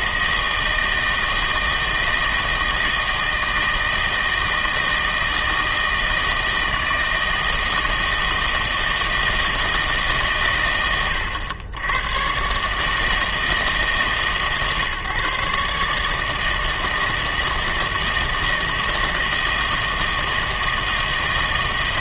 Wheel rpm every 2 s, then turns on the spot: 160, 160, 160, 160, 160, 130, 140, 140, 160, 160, 160.
none